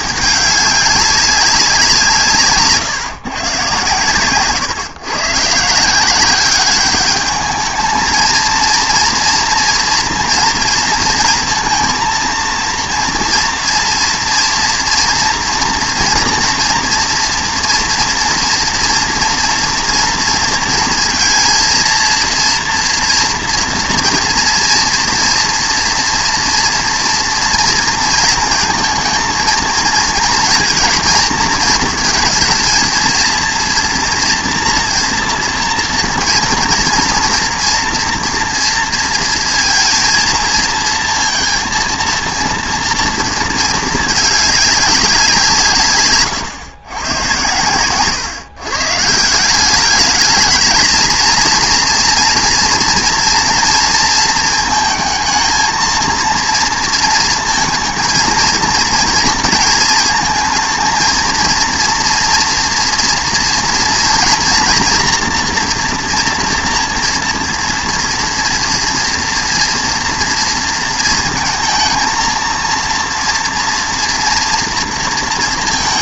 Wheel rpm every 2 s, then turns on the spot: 200, 140, 130, 200, 230, 230, 230, 230, 230, 230, 230, 230, 230, 230, 230, 230, 230, 240, 230, 230, 230, 230, 200, 120, 130, 220, 230, 220, 230, 230, 220, 230, 230, 230, 230, 230, 230, 230.
none